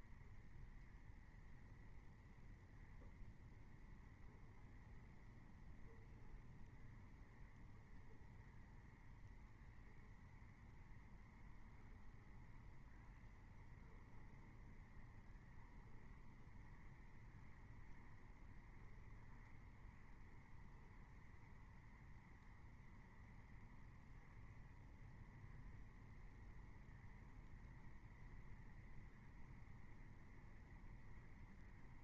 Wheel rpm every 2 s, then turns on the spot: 0, 0, 0, 0, 0, 0, 0, 0, 0, 0, 0, 0, 0, 0, 0, 0.
none